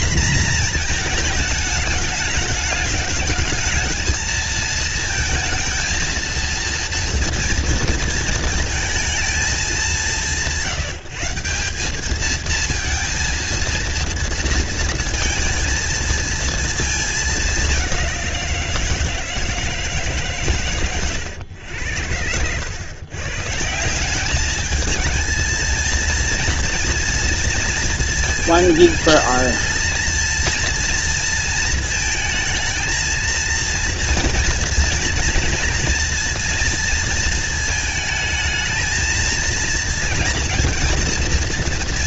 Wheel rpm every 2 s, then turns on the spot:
230, 210, 220, 230, 230, 140, 220, 230, 220, 170, 130, 110, 220, 240, 230, 230, 220, 230, 230, 220, 230.
none